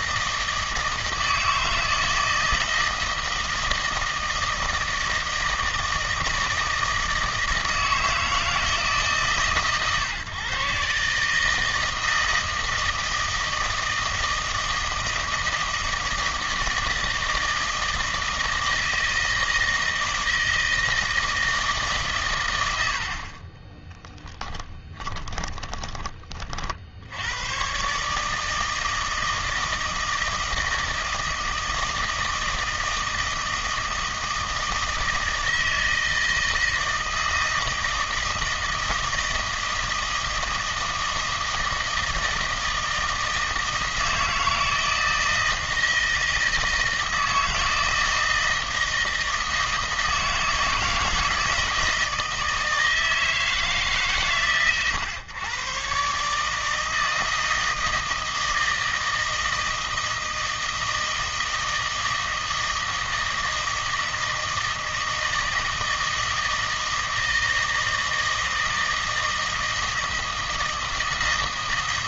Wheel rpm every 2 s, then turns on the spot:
160, 160, 160, 160, 160, 140, 160, 160, 160, 160, 160, 100, 10, 50, 160, 160, 160, 160, 160, 160, 160, 160, 160, 160, 160, 160, 160, 130, 160, 160, 160, 160, 160, 160, 160, 160.
22-26